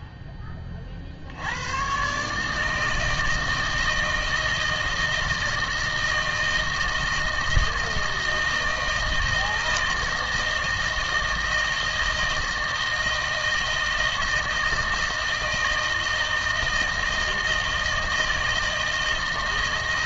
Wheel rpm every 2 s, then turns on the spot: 30, 150, 160, 160, 160, 160, 160, 160, 160, 160.
none